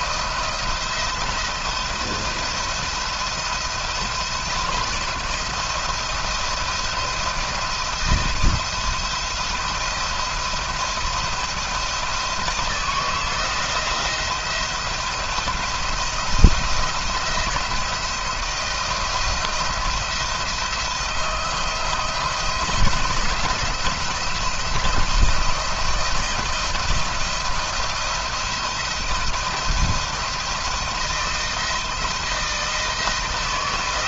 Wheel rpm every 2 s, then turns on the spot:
170, 170, 170, 170, 170, 170, 160, 170, 170, 170, 170, 160, 170, 170, 170, 160, 160.
none